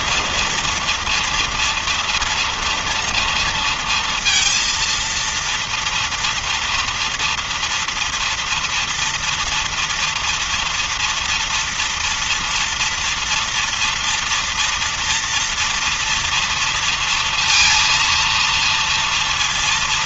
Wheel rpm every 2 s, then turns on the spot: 230, 230, 230, 230, 240, 230, 230, 230, 230, 230.
none